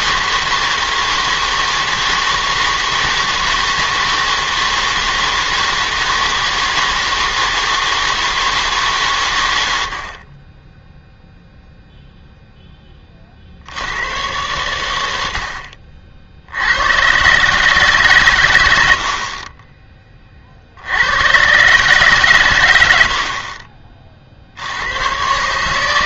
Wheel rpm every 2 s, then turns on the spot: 160, 160, 160, 160, 160, 20, 10, 110, 80, 110, 60, 120, 60.
none